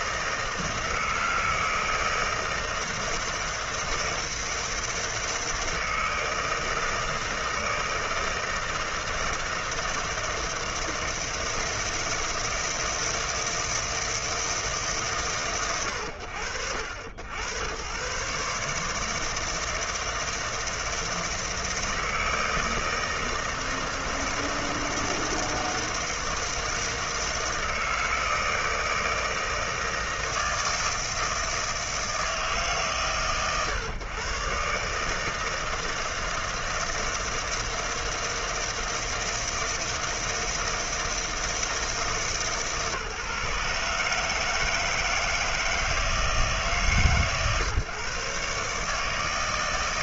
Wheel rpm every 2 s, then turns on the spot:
160, 160, 160, 160, 160, 160, 160, 160, 80, 150, 160, 160, 160, 160, 160, 160, 130, 150, 160, 160, 160, 150, 160, 140, 150.
none